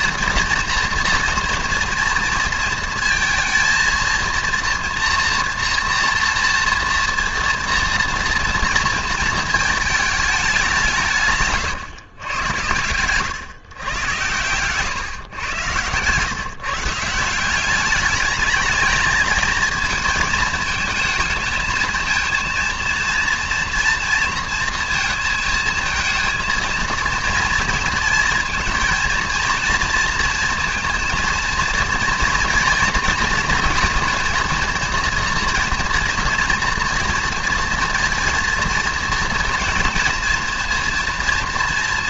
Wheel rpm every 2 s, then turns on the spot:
230, 230, 230, 230, 230, 210, 110, 110, 140, 210, 220, 230, 230, 230, 230, 230, 240, 230, 230, 230, 230.
14-16